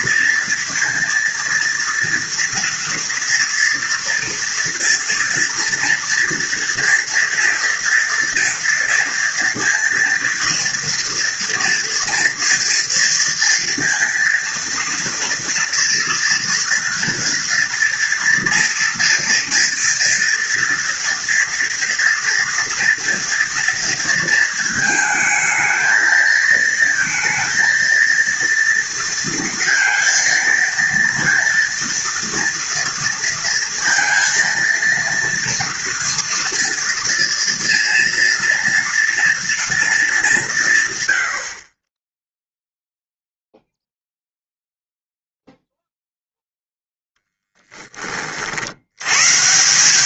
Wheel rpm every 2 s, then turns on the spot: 230, 230, 230, 230, 230, 240, 230, 230, 230, 230, 230, 230, 230, 230, 230, 230, 230, 230, 230, 230, 120, 0, 0, 0, 100.
none